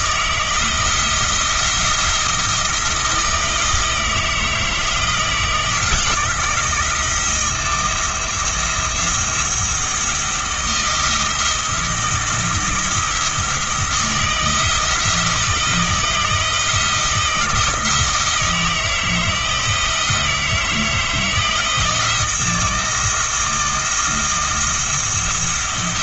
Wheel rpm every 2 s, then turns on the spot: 160, 170, 160, 170, 170, 160, 170, 170, 170, 160, 160, 160, 170.
none